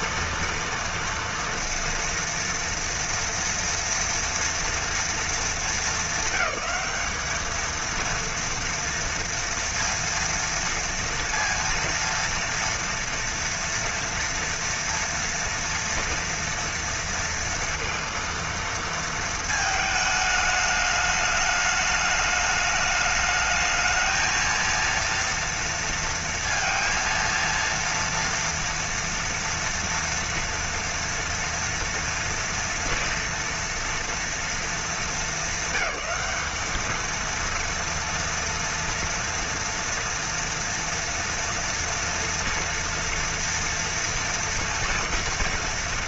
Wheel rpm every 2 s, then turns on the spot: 230, 230, 230, 220, 230, 230, 230, 230, 230, 230, 210, 210, 220, 230, 230, 230, 230, 230, 210, 230, 230, 240, 240.
none